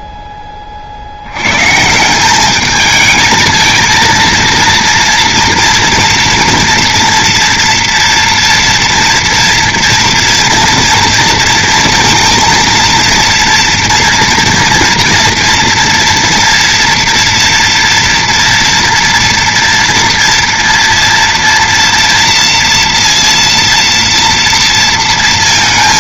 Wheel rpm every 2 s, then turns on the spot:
30, 210, 230, 230, 230, 230, 230, 230, 240, 230, 230, 230, 230.
none